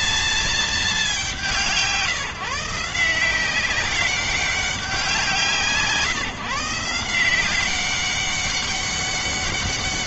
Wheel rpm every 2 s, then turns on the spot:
220, 160, 190, 160, 200.
none